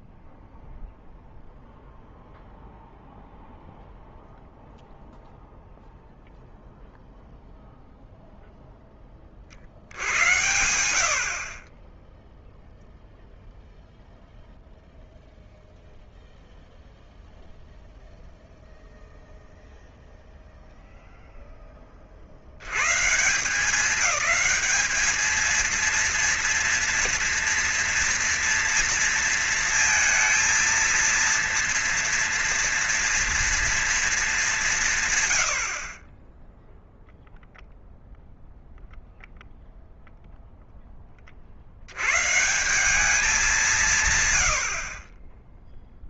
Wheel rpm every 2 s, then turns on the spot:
0, 0, 0, 0, 0, 100, 10, 0, 0, 0, 0, 100, 210, 230, 230, 230, 240, 170, 10, 0, 10, 160, 70.
none